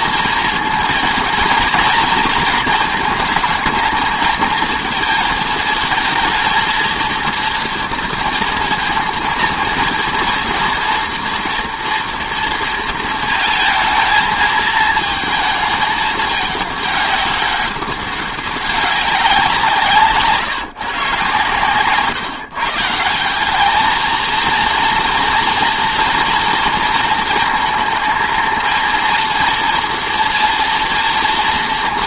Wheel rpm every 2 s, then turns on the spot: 230, 230, 230, 230, 230, 230, 230, 220, 210, 190, 160, 150, 230, 230, 230, 230.
none